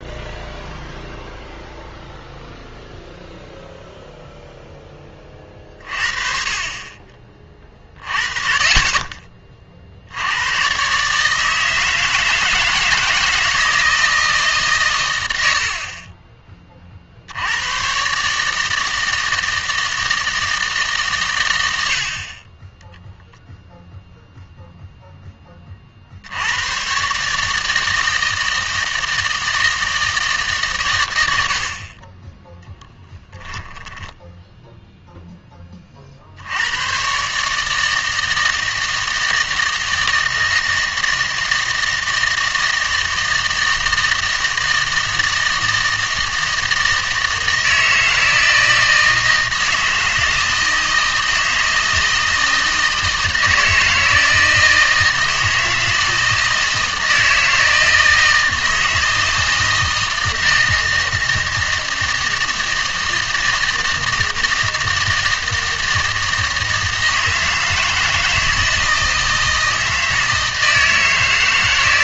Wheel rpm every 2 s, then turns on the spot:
0, 0, 0, 30, 40, 110, 160, 140, 30, 150, 160, 20, 0, 100, 160, 150, 10, 0, 90, 160, 160, 160, 160, 160, 160, 160, 160, 160, 160, 160, 160, 160, 160, 160, 160, 160.
none